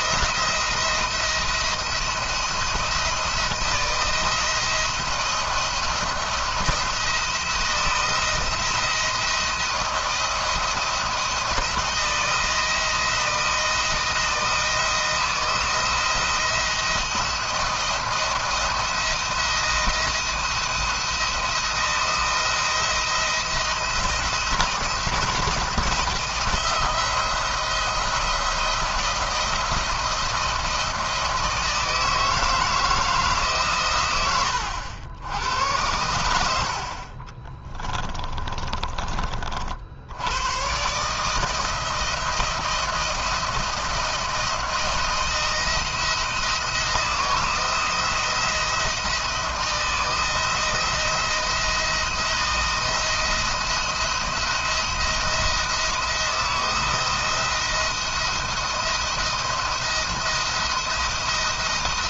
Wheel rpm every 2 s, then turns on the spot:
170, 170, 170, 160, 170, 170, 170, 160, 170, 170, 170, 170, 170, 170, 170, 160, 160, 80, 50, 30, 130, 170, 170, 160, 170, 170, 170, 170, 170, 170, 170.
none